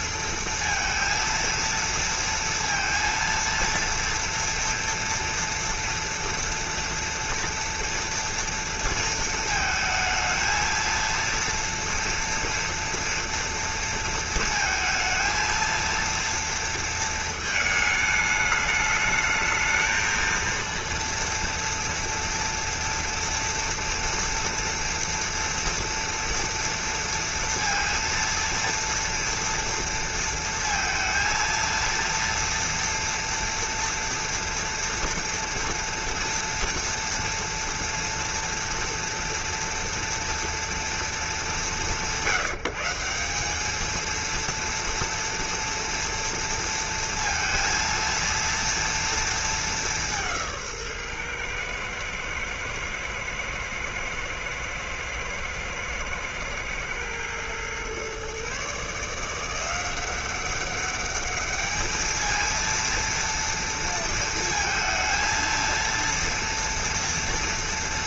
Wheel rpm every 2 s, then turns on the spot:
230, 230, 230, 230, 230, 230, 230, 230, 220, 220, 230, 230, 230, 230, 230, 230, 230, 230, 230, 230, 200, 190, 230, 230, 230, 130, 110, 110, 120, 170, 210, 230, 230, 230.
none